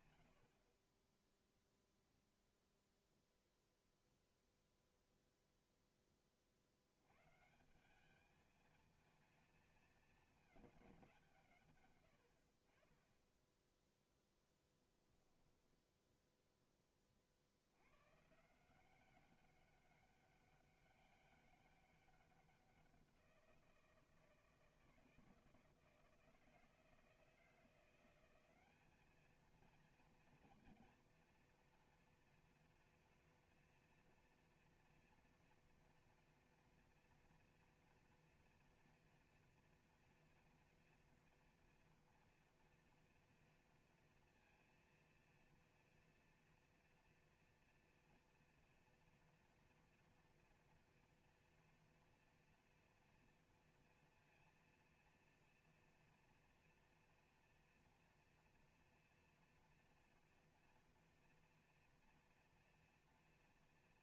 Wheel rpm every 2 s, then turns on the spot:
20, 0, 0, 100, 220, 190, 20, 10, 30, 190, 200, 180, 160, 160, 210, 240, 230, 240, 230, 230, 230, 230, 230, 230, 240, 230, 230, 240, 240, 240, 240, 230.
14-16